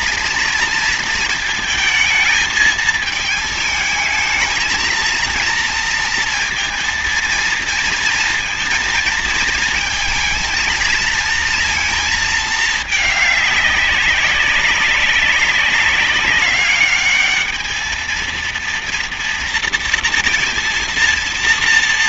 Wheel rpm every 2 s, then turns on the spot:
230, 220, 220, 230, 230, 220, 210, 200, 200, 230, 230.
none